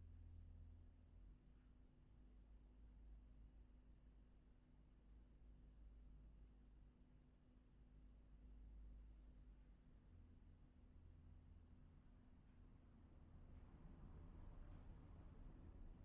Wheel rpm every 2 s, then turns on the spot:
0, 0, 0, 0, 0, 0, 0, 0.
none